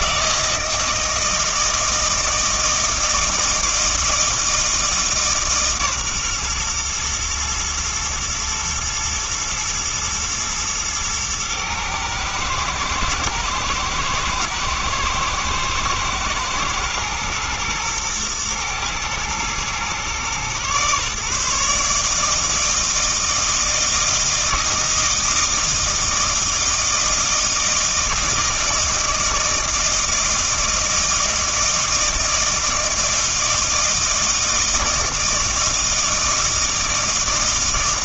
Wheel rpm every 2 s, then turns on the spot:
160, 160, 160, 120, 110, 110, 110, 110, 120, 110, 130, 160, 160, 160, 160, 160, 160, 160, 160.
none